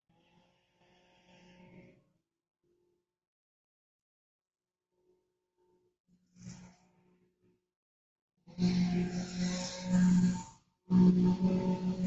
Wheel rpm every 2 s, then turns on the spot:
0, 0, 0, 0, 0, 0.
none